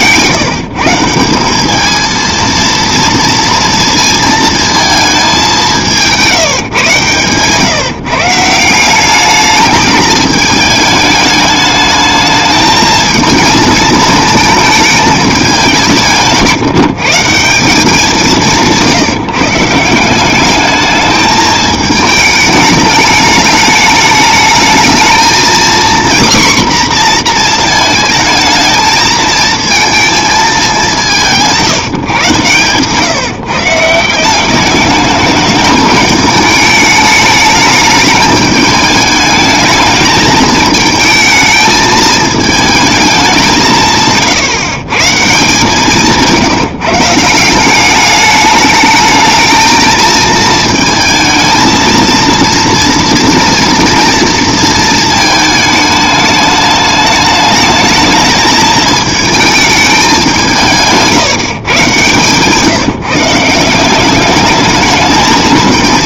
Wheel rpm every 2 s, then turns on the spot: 150, 230, 220, 150, 180, 210, 220, 220, 150, 170, 210, 210, 220, 250, 220, 200, 140, 210, 210, 210, 220, 220, 130, 160, 210, 230, 230, 230, 210, 220, 170, 150, 210.
none